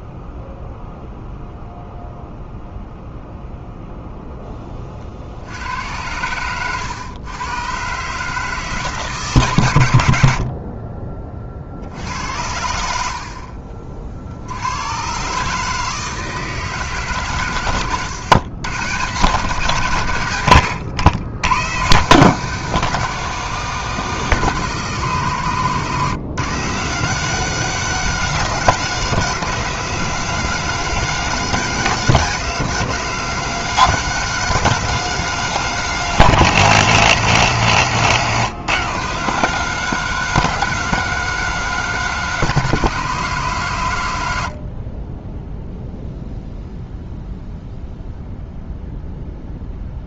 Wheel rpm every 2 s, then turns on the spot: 0, 0, 30, 110, 160, 50, 80, 100, 150, 120, 100, 190, 150, 150, 170, 170, 170, 170, 160, 150, 180, 160, 50, 0, 0.
10-14